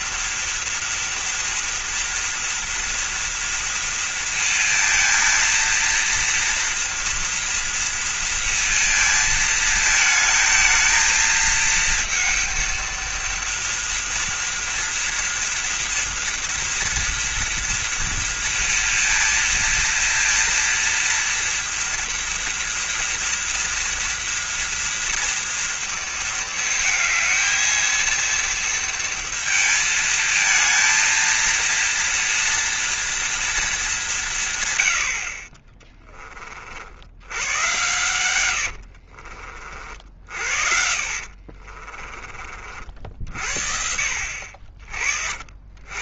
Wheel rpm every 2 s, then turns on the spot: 230, 230, 230, 230, 230, 220, 230, 230, 230, 230, 230, 230, 240, 230, 230, 230, 230, 110, 50, 90, 60, 40, 60.
38-42